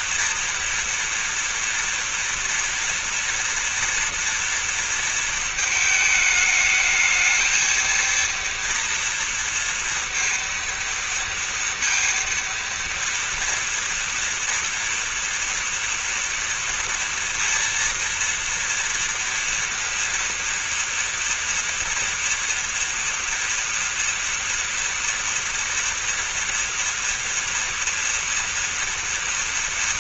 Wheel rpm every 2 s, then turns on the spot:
240, 230, 230, 220, 230, 230, 230, 230, 230, 230, 240, 230, 230, 230, 230.
none